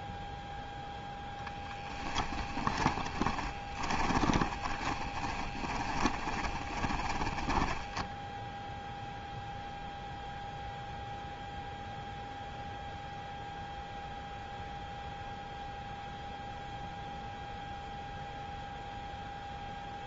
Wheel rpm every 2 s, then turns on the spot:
0, 20, 20, 30, 0, 0, 0, 0, 0, 0.
2-8